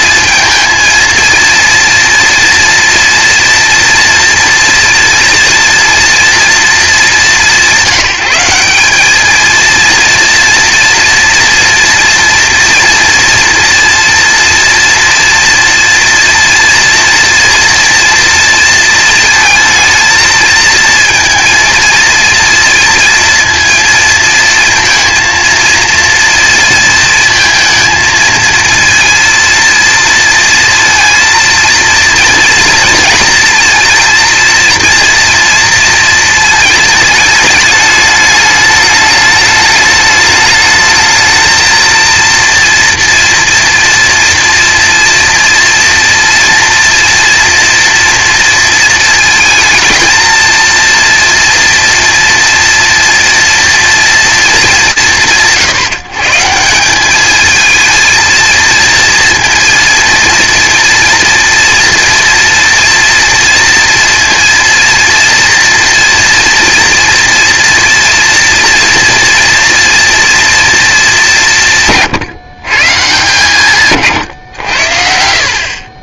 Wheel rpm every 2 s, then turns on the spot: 230, 230, 230, 230, 180, 230, 230, 230, 230, 230, 220, 230, 220, 230, 230, 230, 230, 230, 220, 210, 220, 230, 230, 240, 230, 230, 240, 190, 170, 230, 230, 230, 230, 230, 230, 230, 160, 80.
none